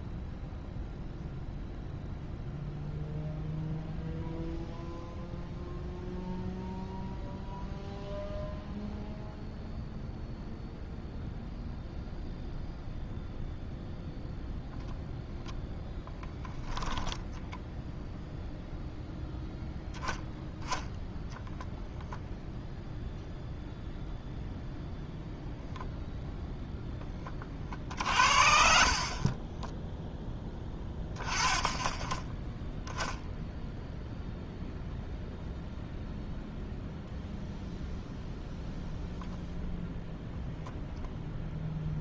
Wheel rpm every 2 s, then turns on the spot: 0, 0, 0, 0, 0, 0, 0, 0, 0, 0, 10, 0, 0, 0, 50, 10, 10, 0, 0, 0, 0.
28-30